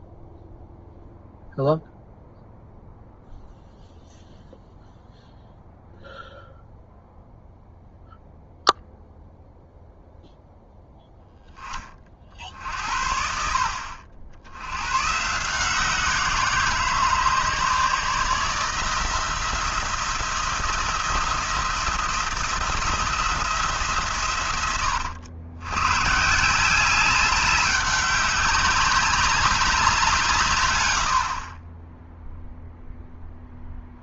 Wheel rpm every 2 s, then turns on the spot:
0, 0, 0, 0, 0, 0, 60, 100, 160, 160, 170, 160, 100, 190, 190, 120, 0.
none